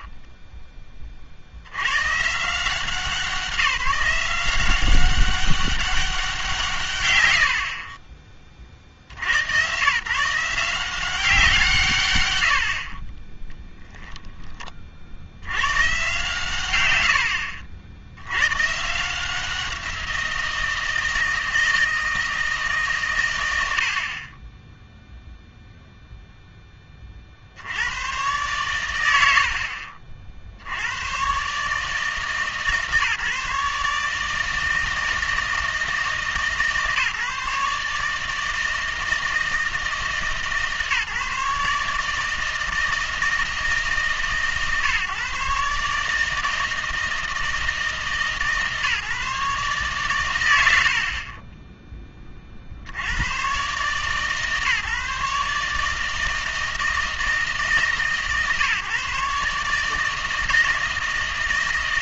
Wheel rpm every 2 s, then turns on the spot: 20, 160, 180, 160, 40, 170, 80, 20, 110, 120, 170, 160, 20, 0, 110, 80, 150, 160, 140, 160, 150, 160, 140, 160, 150, 50, 40, 150, 160, 140, 160.
0-2 50-52